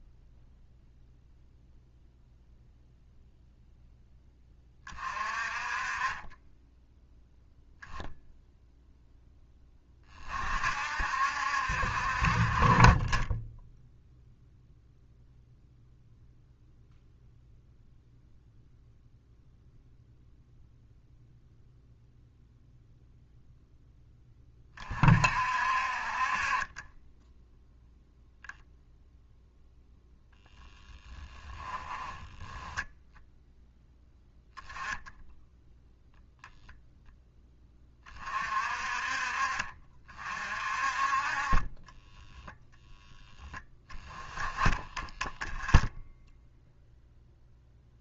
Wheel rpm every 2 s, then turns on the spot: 0, 0, 20, 10, 0, 50, 40, 0, 0, 0, 0, 0, 30, 30, 0, 0, 10, 0, 0, 40, 40, 0, 20, 0.
44-46